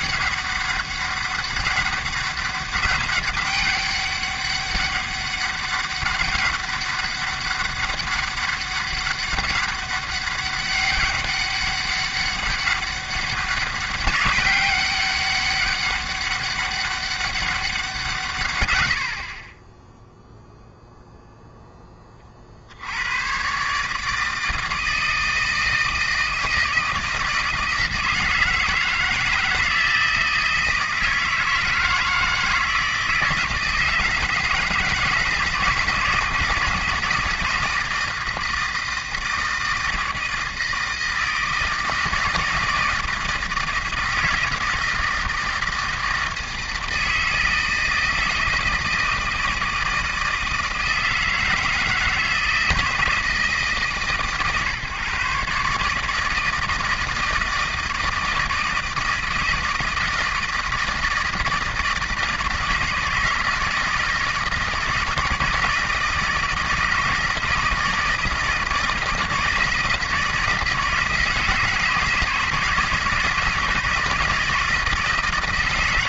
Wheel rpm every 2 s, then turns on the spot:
200, 200, 200, 200, 200, 200, 200, 190, 190, 90, 0, 80, 160, 160, 160, 160, 160, 160, 160, 160, 160, 160, 160, 160, 160, 160, 160, 140, 160, 160, 160, 160, 160, 160, 160, 160, 160, 160.
none